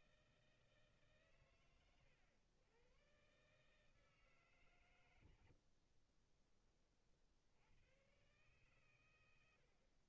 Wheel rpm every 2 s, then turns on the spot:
110, 140, 20, 130, 100.
none